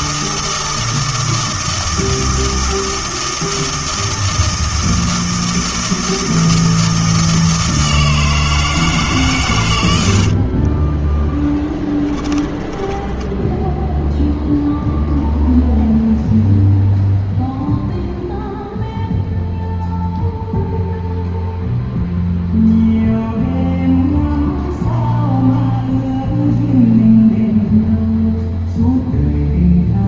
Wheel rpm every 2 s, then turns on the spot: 160, 160, 160, 160, 160, 30, 20, 0, 0, 0, 0, 0, 0, 0, 0.
10-14